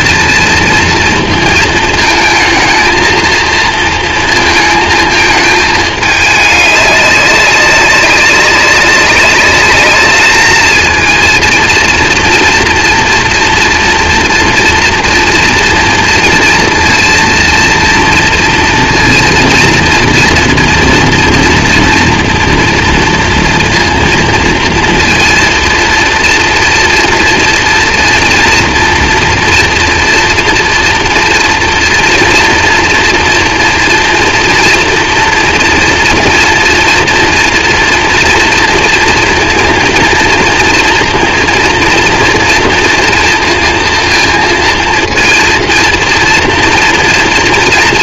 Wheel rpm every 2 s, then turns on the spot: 230, 220, 230, 200, 190, 220, 240, 240, 230, 230, 230, 230, 230, 240, 230, 230, 230, 240, 230, 230, 230, 230, 230, 230.
none